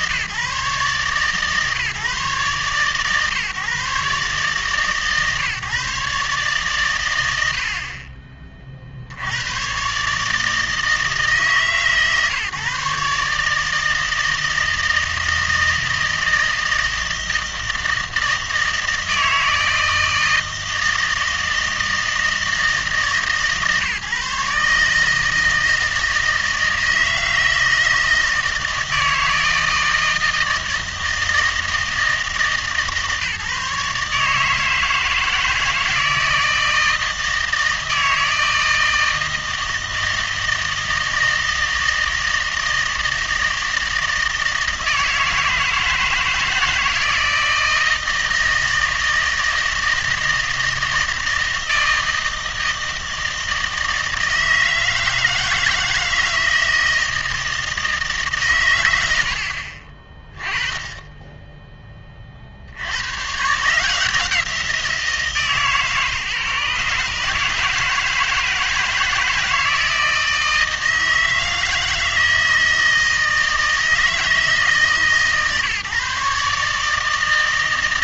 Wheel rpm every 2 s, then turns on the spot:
140, 140, 140, 140, 30, 160, 140, 160, 160, 160, 160, 150, 150, 160, 160, 160, 160, 150, 160, 160, 160, 160, 160, 160, 160, 160, 160, 160, 160, 100, 10, 60, 170, 140, 160, 160, 160, 160, 150.
none